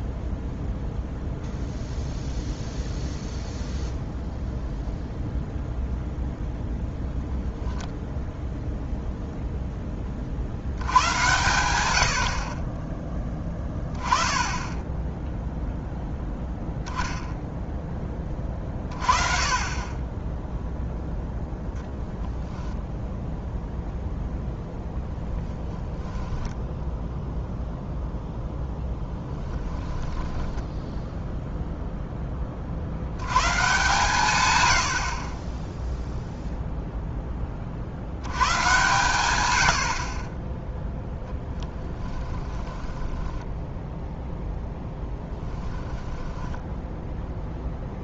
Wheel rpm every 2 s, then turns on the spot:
0, 0, 0, 10, 0, 90, 30, 10, 0, 30, 0, 0, 0, 0, 0, 10, 50, 80, 0, 120, 10, 10, 0, 10.
6-8 30-32 42-44 46-48